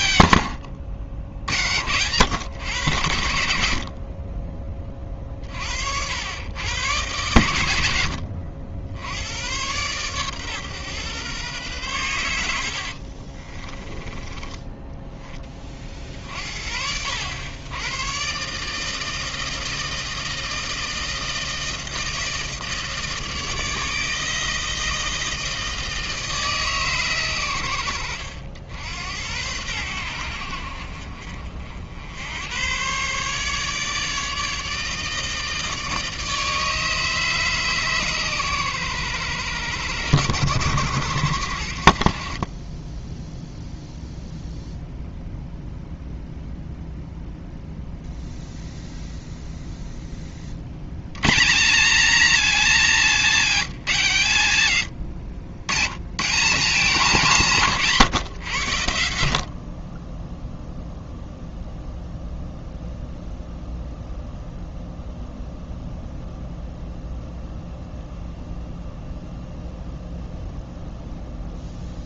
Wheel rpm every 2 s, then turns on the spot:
50, 30, 90, 60, 80, 130, 60, 10, 70, 150, 160, 160, 160, 140, 80, 60, 130, 160, 150, 110, 80, 10, 0, 0, 0, 80, 210, 100, 180, 80, 0, 0, 0, 0, 0, 0.
12-16 42-44